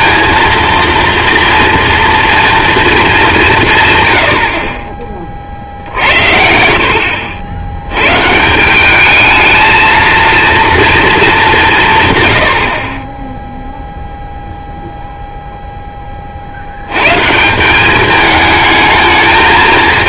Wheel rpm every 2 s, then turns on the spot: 230, 190, 50, 70, 220, 210, 10, 0, 120, 220.
none